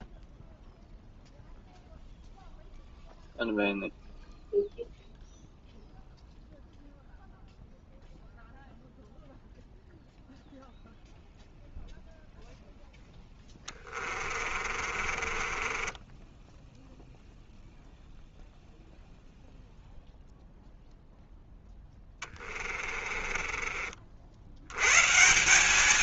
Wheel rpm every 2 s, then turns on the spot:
0, 0, 0, 0, 0, 0, 0, 40, 10, 0, 0, 30, 90.
14-18 22-24